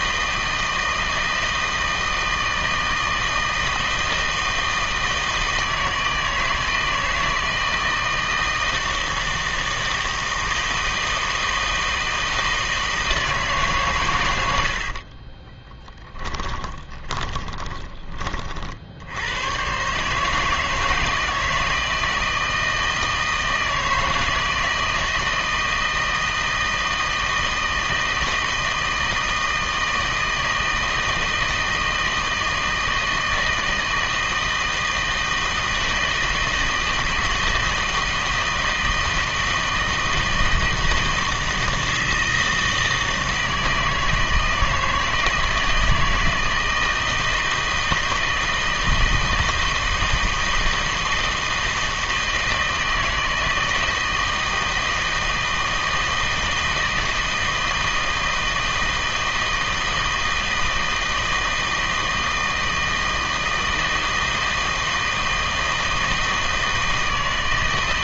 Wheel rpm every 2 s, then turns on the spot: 160, 160, 160, 160, 160, 160, 160, 70, 20, 60, 160, 160, 160, 160, 160, 160, 160, 160, 160, 160, 160, 160, 160, 170, 160, 160, 160, 160, 160, 160, 160, 160, 160, 160.
14-18